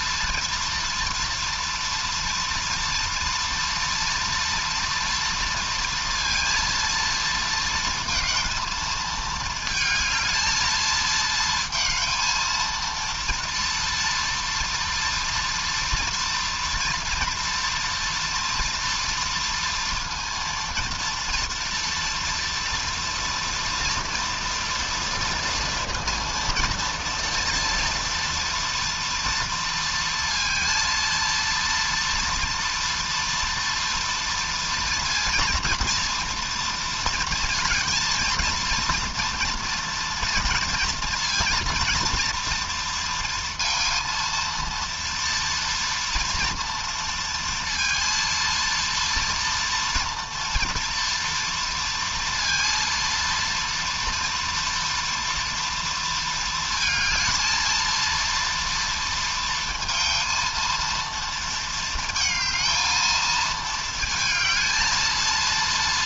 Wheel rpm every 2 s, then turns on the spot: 230, 230, 230, 230, 230, 220, 230, 240, 240, 230, 230, 230, 230, 230, 230, 230, 240, 230, 230, 230, 230, 230, 230, 230, 230, 240, 230, 230, 220, 230, 230, 220, 220.
none